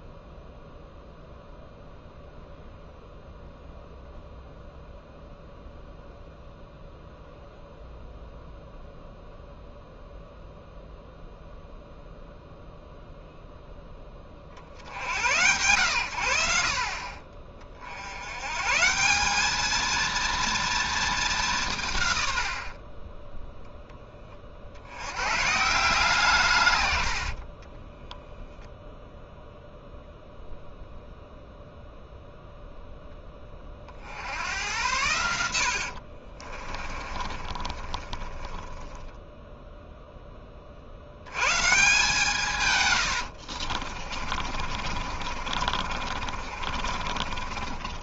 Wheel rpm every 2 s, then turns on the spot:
0, 0, 0, 0, 0, 0, 0, 70, 60, 150, 230, 40, 70, 120, 0, 0, 0, 90, 30, 10, 50, 130, 50, 50.
36-40 42-48